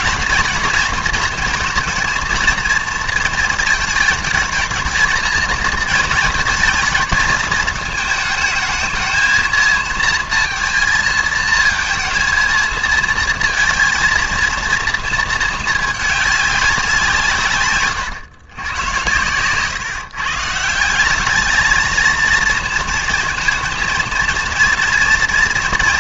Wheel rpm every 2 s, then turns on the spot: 230, 230, 220, 220, 220, 220, 230, 230, 200, 120, 150, 230, 230.
none